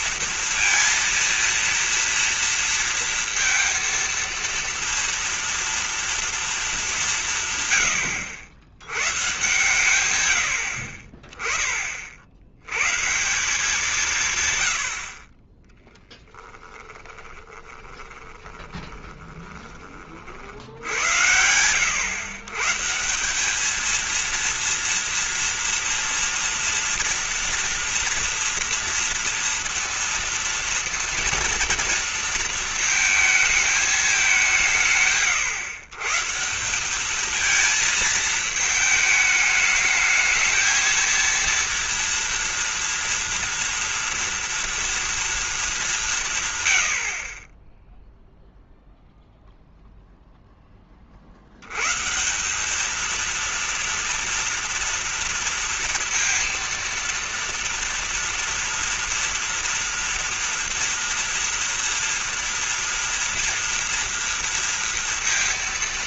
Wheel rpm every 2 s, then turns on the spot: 230, 230, 230, 210, 100, 70, 120, 100, 10, 20, 70, 140, 230, 230, 230, 230, 230, 160, 190, 220, 230, 240, 230, 110, 0, 10, 200, 230, 230, 230, 240, 230, 230.
10-12 16-20